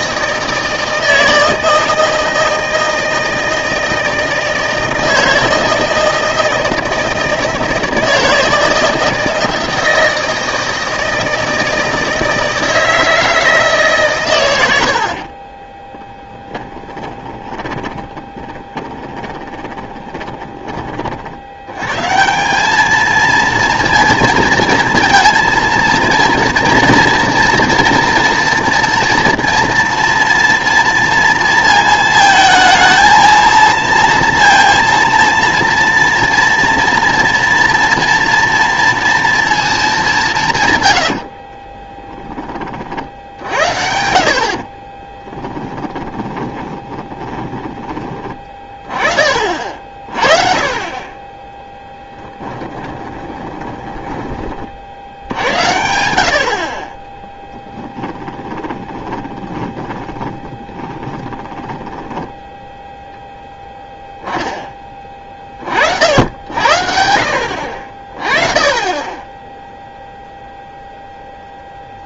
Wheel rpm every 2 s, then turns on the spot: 160, 160, 160, 160, 160, 160, 160, 90, 10, 20, 30, 200, 230, 230, 230, 230, 230, 230, 230, 230, 140, 40, 40, 20, 20, 30, 20, 50, 40, 20, 10, 10, 10, 70, 20, 0.
16-20 44-48 52-54 58-62